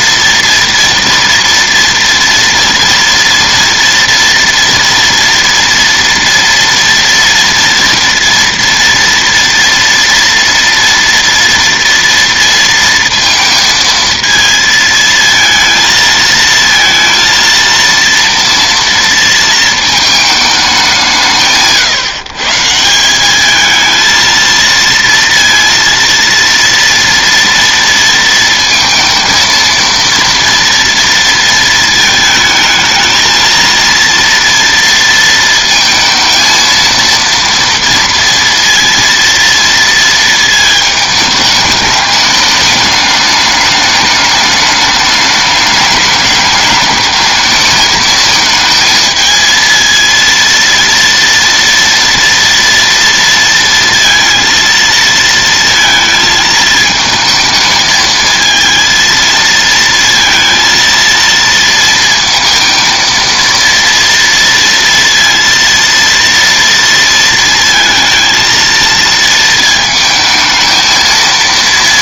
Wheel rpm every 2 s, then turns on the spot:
230, 230, 240, 230, 230, 240, 230, 220, 230, 230, 200, 150, 230, 230, 230, 230, 220, 230, 230, 230, 220, 210, 210, 210, 220, 230, 230, 230, 220, 220, 230, 230, 230, 230, 230, 220.
none